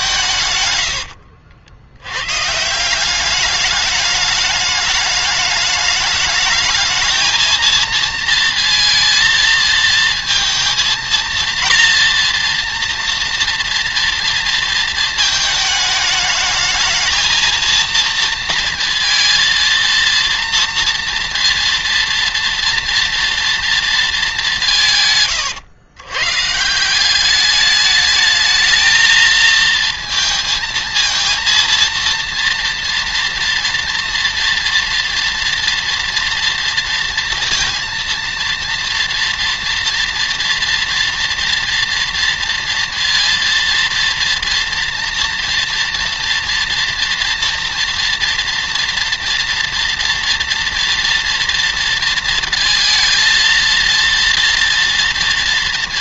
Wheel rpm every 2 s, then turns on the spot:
100, 160, 210, 210, 230, 230, 230, 230, 220, 230, 230, 230, 170, 180, 220, 230, 230, 230, 240, 230, 230, 230, 230, 230, 240, 230, 230, 230.
0-2